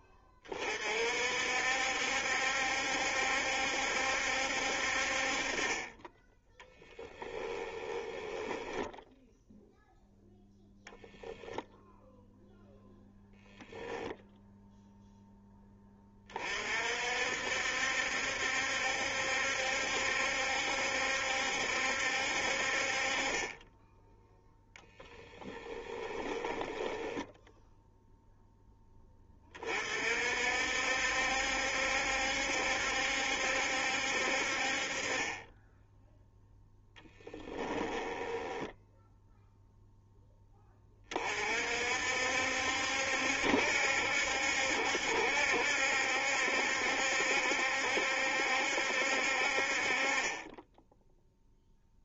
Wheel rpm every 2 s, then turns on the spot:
50, 70, 50, 10, 10, 0, 0, 0, 40, 70, 70, 40, 10, 10, 10, 60, 70, 40, 0, 10, 20, 70, 70, 70, 70, 10.
8-10 24-28 38-40